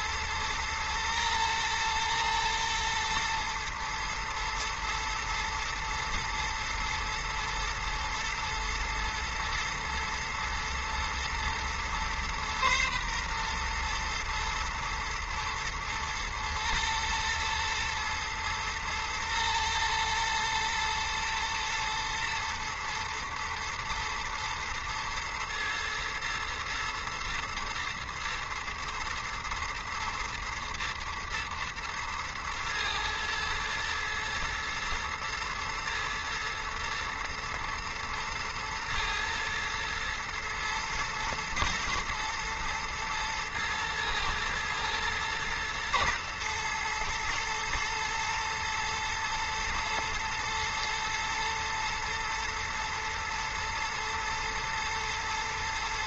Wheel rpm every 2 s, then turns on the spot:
120, 120, 120, 110, 120, 110, 120, 110, 120, 120, 110, 120, 120, 120, 110, 110, 110, 110, 120, 110, 120, 110, 120, 120, 120, 110, 110, 120.
none